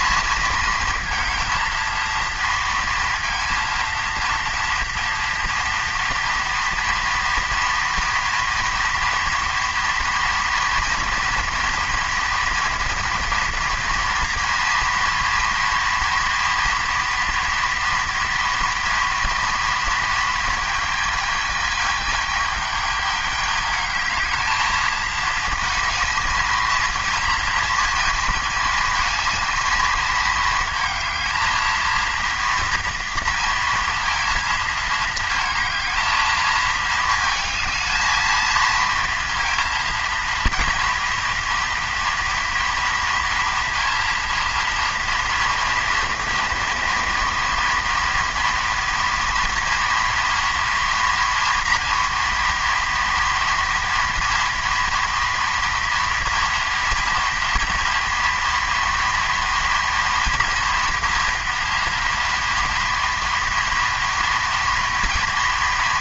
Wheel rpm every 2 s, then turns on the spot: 230, 230, 230, 230, 230, 240, 230, 230, 230, 230, 210, 210, 220, 230, 220, 230, 230, 220, 220, 230, 230, 230, 240, 230, 240, 230, 230, 230, 230, 230, 230, 230, 230.
none